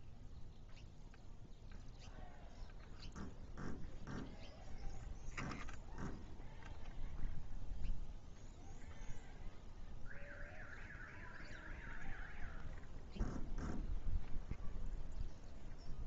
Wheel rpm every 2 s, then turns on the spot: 0, 0, 0, 0, 0, 0, 0, 0.
none